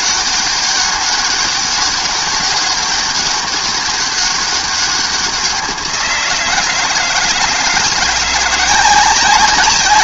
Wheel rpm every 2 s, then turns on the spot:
200, 200, 200, 170, 180.
none